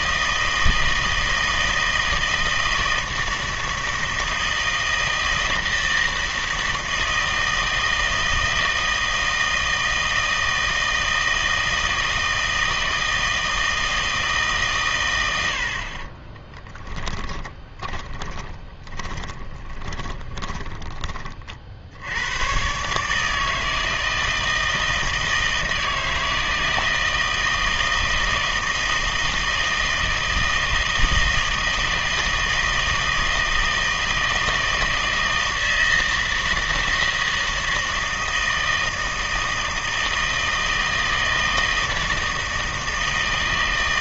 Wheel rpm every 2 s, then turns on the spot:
160, 160, 160, 160, 160, 160, 160, 140, 20, 20, 20, 120, 160, 160, 160, 160, 160, 160, 160, 160, 160, 160.
16-22